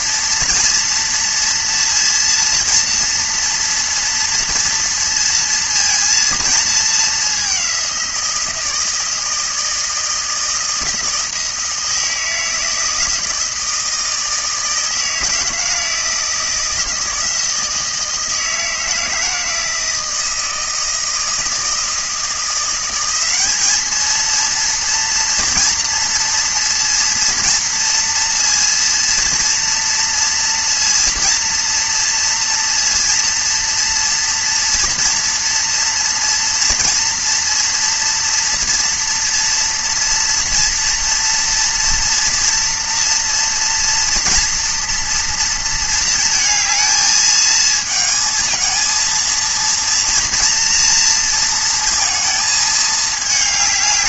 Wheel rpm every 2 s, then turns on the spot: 230, 230, 230, 210, 160, 160, 160, 160, 160, 160, 160, 190, 230, 230, 230, 230, 230, 230, 230, 230, 230, 230, 240, 220, 230, 230, 220.
none